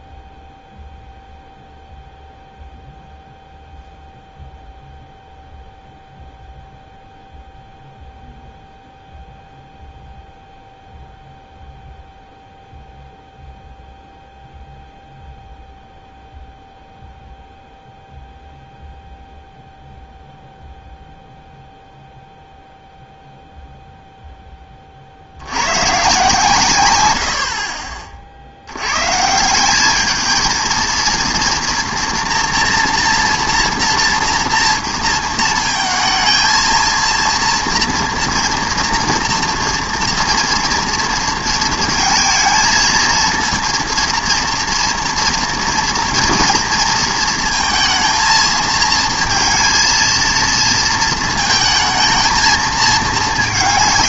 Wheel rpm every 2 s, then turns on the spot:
0, 0, 0, 0, 0, 0, 0, 0, 0, 0, 0, 0, 10, 120, 80, 230, 230, 230, 230, 240, 230, 220, 230, 230, 220, 230, 220.
none